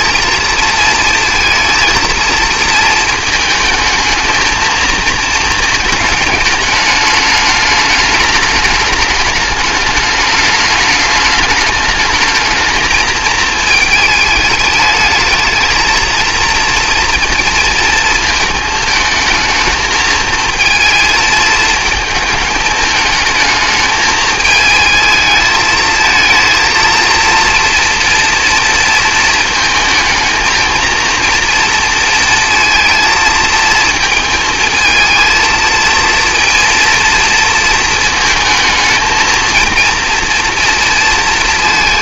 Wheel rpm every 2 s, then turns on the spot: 220, 220, 230, 210, 210, 210, 220, 210, 230, 220, 220, 210, 220, 230, 230, 230, 230, 230, 230, 220, 230.
none